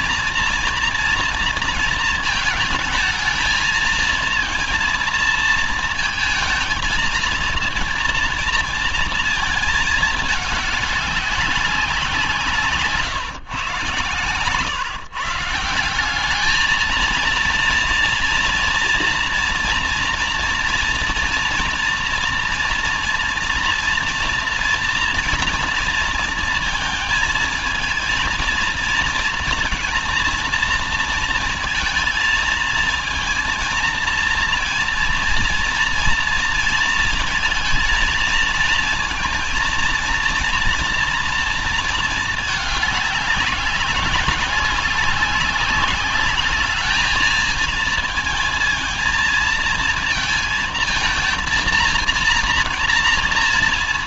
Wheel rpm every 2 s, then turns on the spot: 230, 220, 230, 230, 230, 200, 130, 130, 230, 230, 230, 230, 230, 220, 230, 230, 230, 230, 230, 230, 230, 200, 190, 220, 230, 230, 230.
none